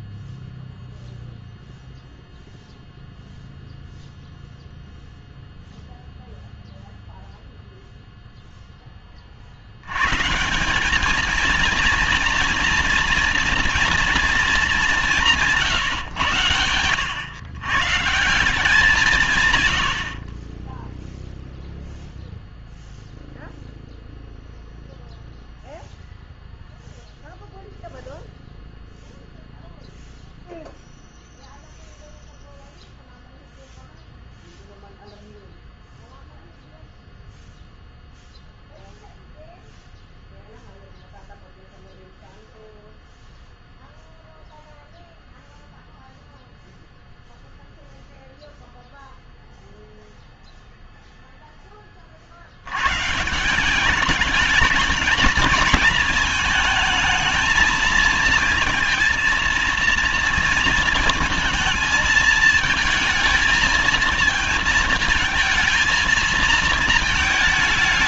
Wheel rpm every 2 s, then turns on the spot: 0, 0, 0, 0, 10, 190, 230, 220, 110, 170, 10, 0, 0, 0, 0, 0, 0, 0, 0, 0, 0, 0, 0, 0, 0, 0, 110, 210, 220, 230, 230, 230, 220, 220.
none